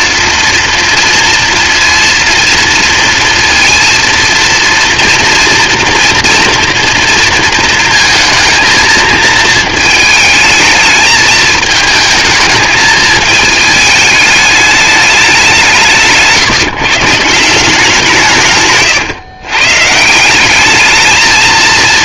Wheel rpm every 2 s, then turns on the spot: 230, 230, 230, 230, 220, 220, 220, 210, 140, 130, 210.
18-20